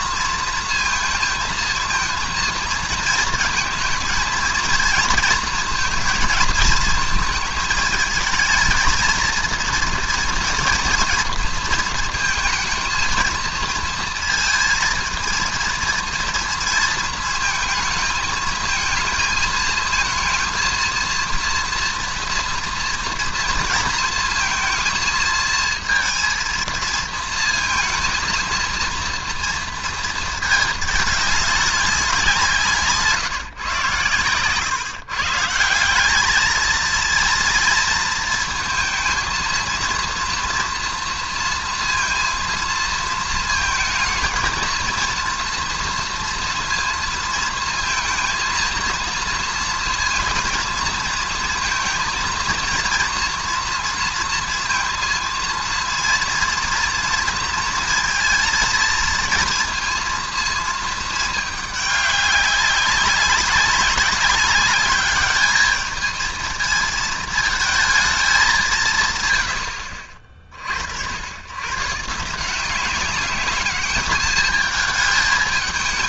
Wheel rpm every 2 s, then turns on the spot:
230, 230, 230, 220, 220, 230, 220, 220, 230, 220, 230, 230, 230, 230, 230, 220, 170, 120, 220, 230, 230, 230, 220, 230, 230, 230, 230, 230, 230, 230, 230, 200, 200, 220, 200, 50, 170, 210.
none